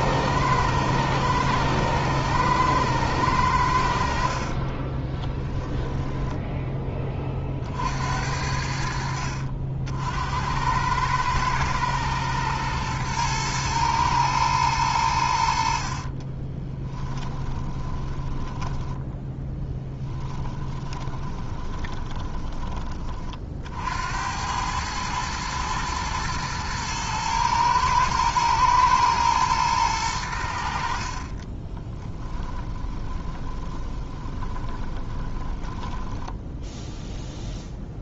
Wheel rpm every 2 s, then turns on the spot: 120, 110, 20, 10, 70, 100, 110, 100, 20, 10, 20, 30, 110, 110, 110, 60, 20, 30, 0.
4-6 16-22 30-36